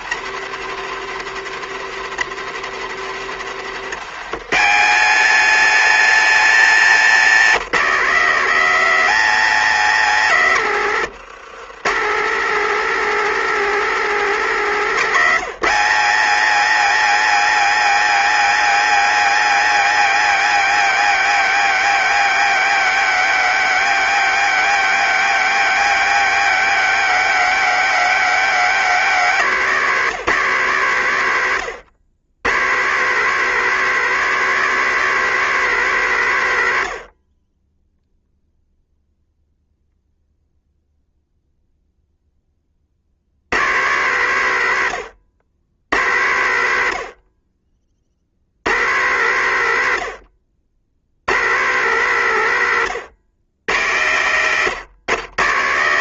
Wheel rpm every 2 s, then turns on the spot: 140, 130, 190, 210, 210, 150, 220, 190, 220, 220, 220, 210, 210, 210, 190, 140, 150, 200, 80, 0, 0, 50, 90, 80, 110, 90, 120, 130.
none